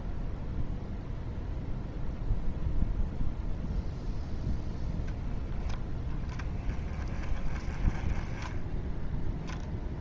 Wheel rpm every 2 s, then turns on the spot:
0, 0, 0, 20, 10.
none